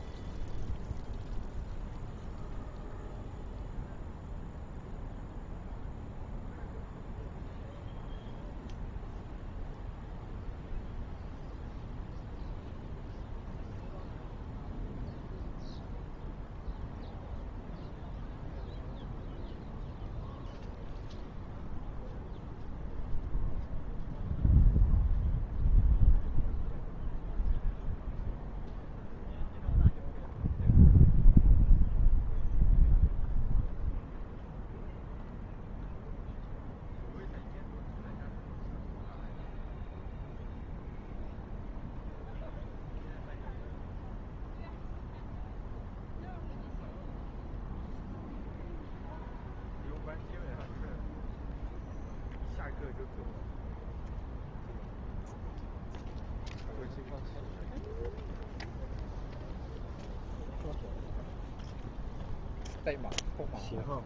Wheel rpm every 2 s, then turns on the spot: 0, 0, 0, 0, 0, 0, 0, 0, 0, 0, 0, 0, 0, 0, 0, 0, 0, 0, 0, 0, 0, 0, 0, 0, 0, 0, 0, 0, 0, 0, 0, 0.
none